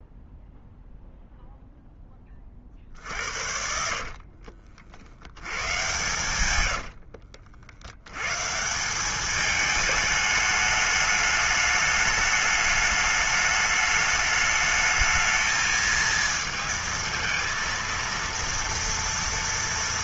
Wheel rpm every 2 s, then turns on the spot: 0, 20, 50, 120, 100, 210, 210, 210, 220, 230.
4-8